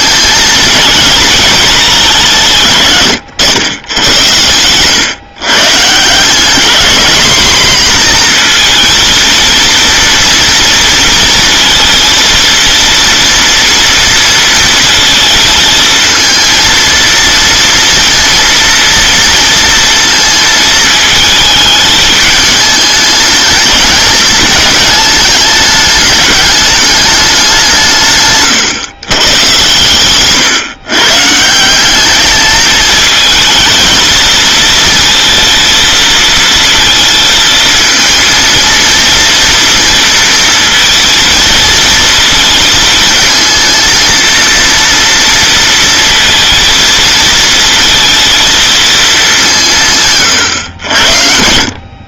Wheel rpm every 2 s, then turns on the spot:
220, 130, 120, 220, 230, 230, 230, 230, 230, 230, 220, 220, 210, 210, 120, 130, 220, 230, 230, 230, 230, 220, 230, 230, 220, 80.
none